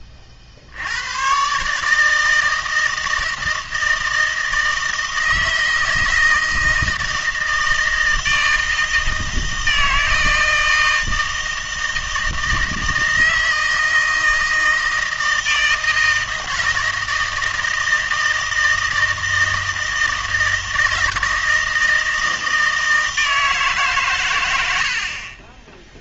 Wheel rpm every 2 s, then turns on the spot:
60, 160, 160, 160, 160, 160, 160, 160, 160, 160, 160, 160, 100.
none